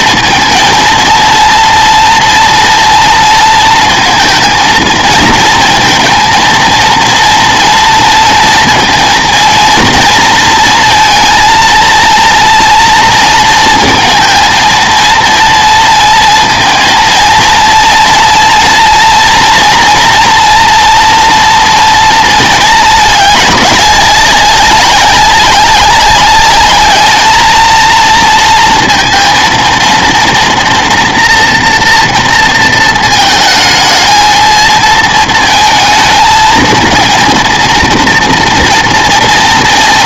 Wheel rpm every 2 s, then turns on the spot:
230, 230, 230, 230, 230, 230, 230, 230, 230, 230, 230, 220, 200, 210, 230, 240, 220, 230, 230, 230.
none